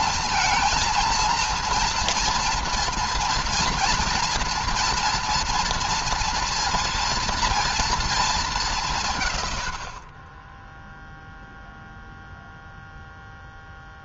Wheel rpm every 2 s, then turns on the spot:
230, 230, 230, 230, 190, 10, 0.
none